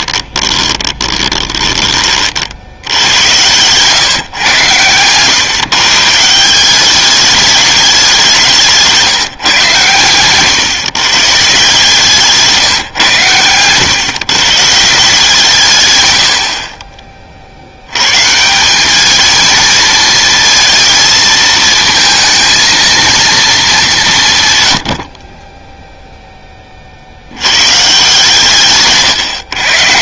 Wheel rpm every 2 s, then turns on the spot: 20, 70, 120, 180, 180, 130, 140, 150, 50, 170, 230, 220, 130, 20, 140.
0-2 8-10